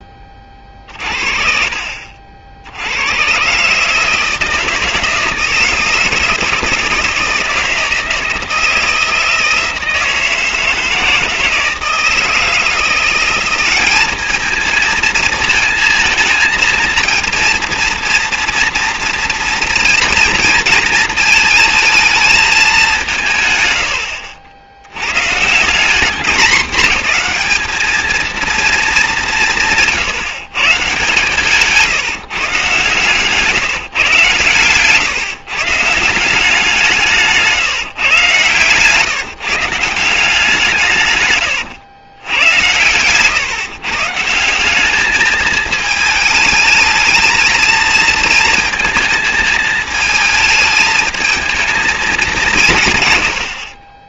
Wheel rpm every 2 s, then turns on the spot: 40, 90, 160, 160, 160, 160, 170, 230, 230, 230, 220, 190, 100, 200, 210, 140, 130, 140, 180, 140, 140, 100, 200, 220, 220, 220, 160.
0-2